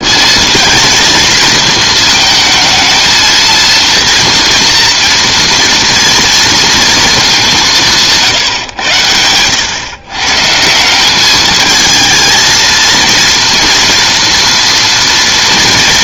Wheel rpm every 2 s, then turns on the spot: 230, 220, 230, 230, 110, 180, 230, 230.
none